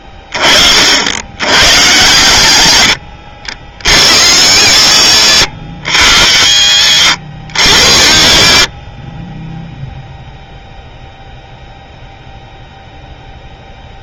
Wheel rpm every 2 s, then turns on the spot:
60, 90, 70, 70, 40, 0, 0.
none